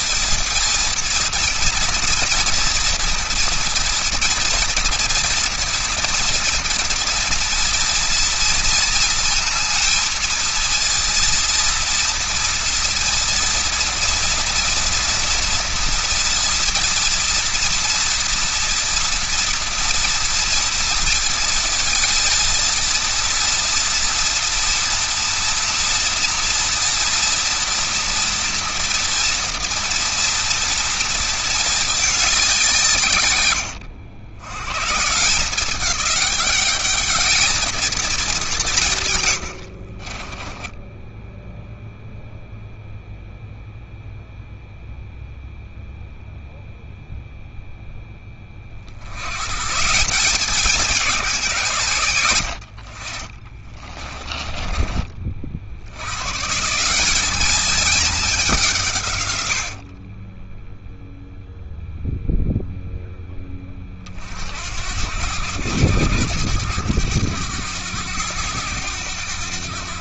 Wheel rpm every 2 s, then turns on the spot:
230, 230, 240, 230, 230, 230, 230, 230, 230, 230, 230, 230, 230, 230, 230, 230, 140, 140, 210, 130, 10, 0, 0, 0, 80, 190, 60, 40, 190, 120, 0, 10, 80, 100, 90.
38-42